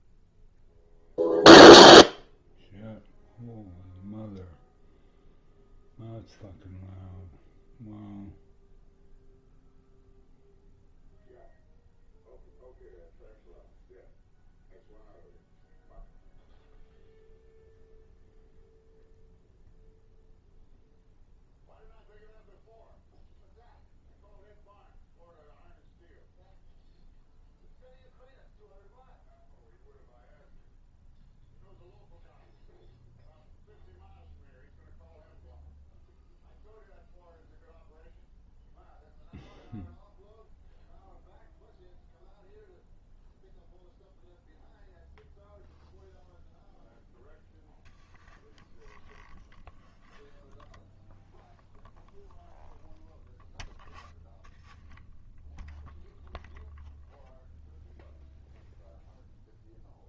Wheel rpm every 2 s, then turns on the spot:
0, 0, 0, 0, 0, 0, 0, 0, 0, 0, 0, 0, 0, 0, 0, 0, 0, 0, 0, 0, 0, 0, 0, 0, 0, 0, 0, 0, 0, 0.
none